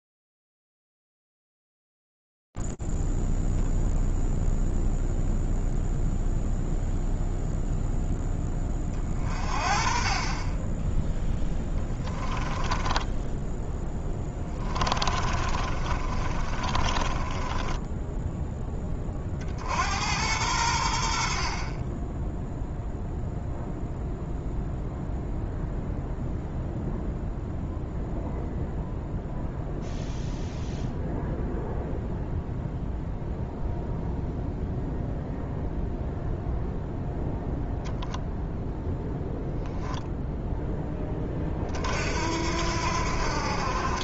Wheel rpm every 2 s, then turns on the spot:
0, 0, 0, 0, 0, 30, 10, 10, 30, 10, 80, 0, 0, 0, 0, 0, 0, 0, 0, 0, 0, 70.
12-20